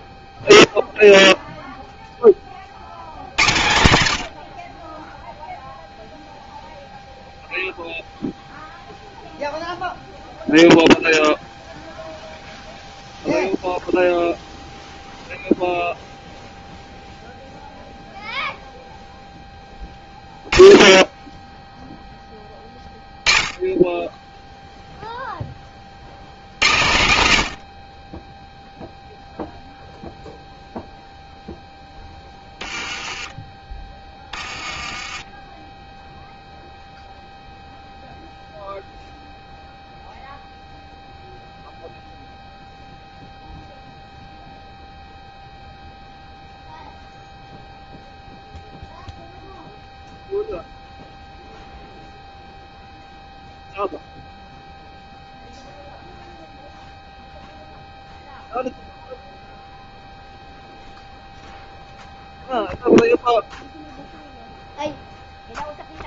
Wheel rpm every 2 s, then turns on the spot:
0, 90, 0, 0, 0, 0, 0, 0, 0, 0, 10, 10, 0, 100, 0, 0, 10, 20, 0, 0, 0, 0, 0, 0, 0, 0, 0, 0, 0, 0, 0, 0, 0.
32-36